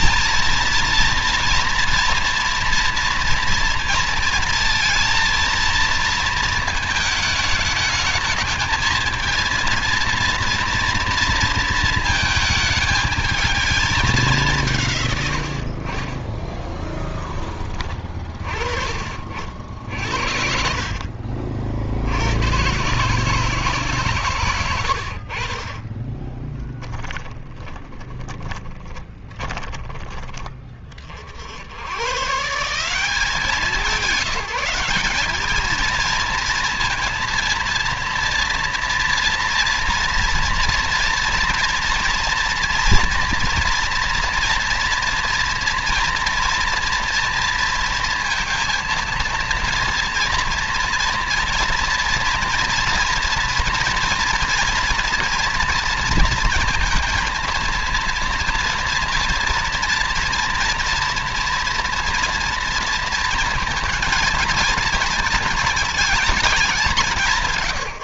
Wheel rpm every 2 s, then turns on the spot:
230, 230, 230, 220, 220, 230, 220, 130, 10, 40, 50, 130, 90, 20, 20, 50, 180, 190, 230, 230, 240, 240, 230, 230, 230, 230, 230, 240, 230, 230, 230, 230, 230, 190.
24-30